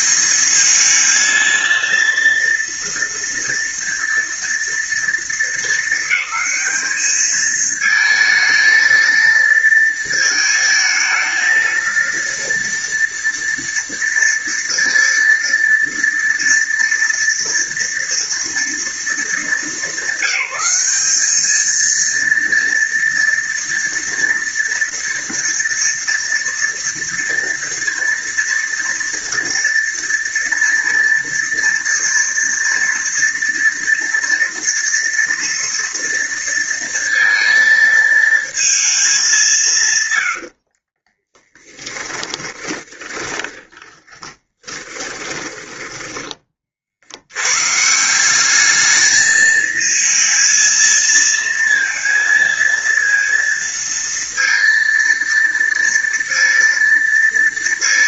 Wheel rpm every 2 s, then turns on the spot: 210, 230, 230, 220, 230, 230, 230, 230, 230, 230, 200, 230, 230, 230, 230, 230, 230, 230, 230, 220, 90, 20, 30, 20, 190, 220, 230, 230, 230.
42-46